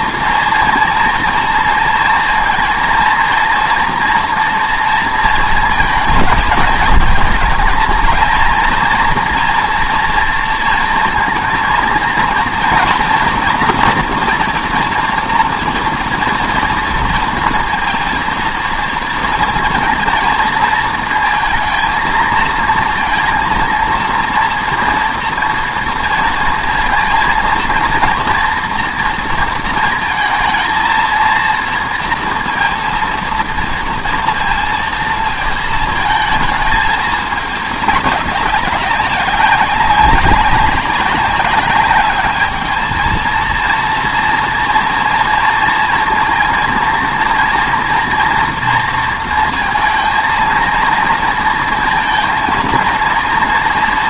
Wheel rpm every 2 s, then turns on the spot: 230, 230, 230, 220, 230, 230, 230, 230, 230, 230, 220, 230, 230, 230, 230, 230, 230, 230, 220, 200, 200, 220, 230, 230, 230, 230, 230.
none